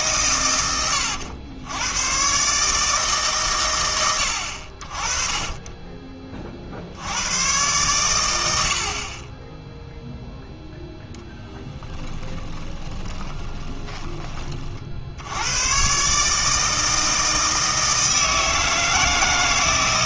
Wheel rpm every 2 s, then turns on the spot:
100, 150, 60, 50, 70, 0, 20, 40, 160, 160.
12-14